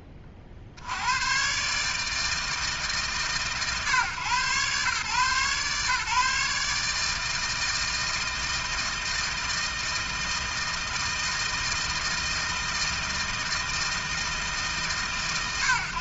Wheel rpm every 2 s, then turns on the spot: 50, 150, 130, 150, 160, 160, 160, 150.
none